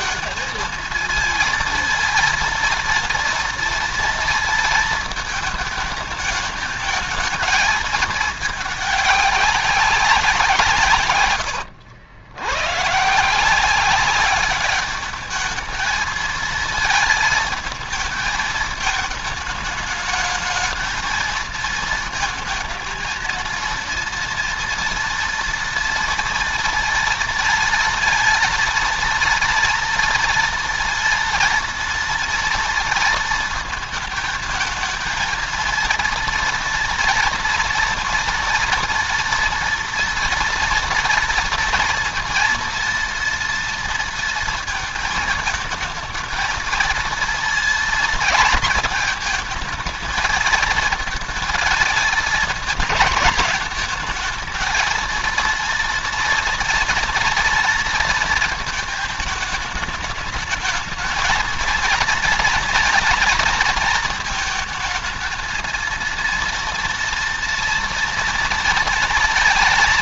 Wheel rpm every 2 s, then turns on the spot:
220, 230, 230, 220, 210, 170, 120, 200, 220, 220, 220, 230, 230, 230, 230, 230, 230, 220, 240, 230, 240, 230, 230, 230, 220, 220, 220, 220, 230, 220, 210, 230, 220, 230, 230.
none